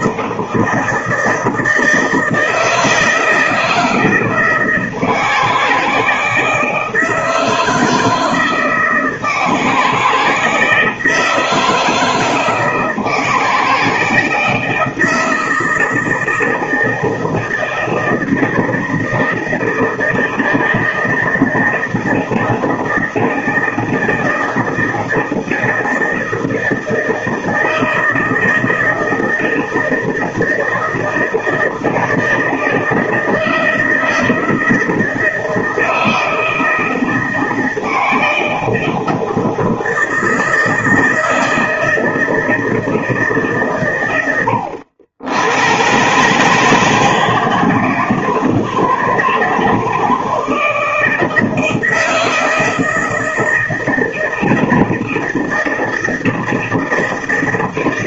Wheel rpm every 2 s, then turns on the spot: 160, 160, 160, 160, 160, 160, 160, 160, 160, 160, 160, 160, 160, 160, 160, 160, 160, 160, 160, 160, 160, 160, 90, 150, 160, 160, 160, 160, 160.
none